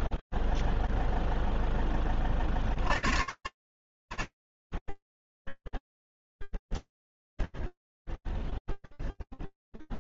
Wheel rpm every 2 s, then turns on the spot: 0, 50, 30, 0, 0.
none